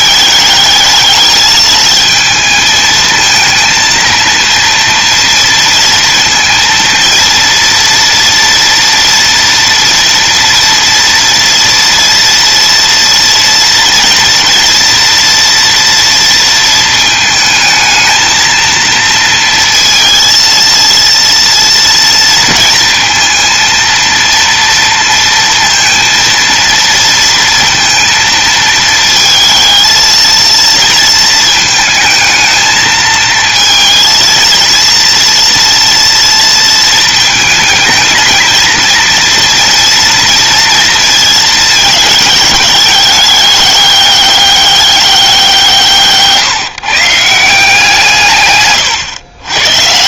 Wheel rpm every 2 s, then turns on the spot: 220, 220, 230, 230, 230, 230, 230, 240, 220, 230, 230, 230, 230, 230, 220, 230, 220, 230, 220, 230, 230, 210, 190, 150, 120.
none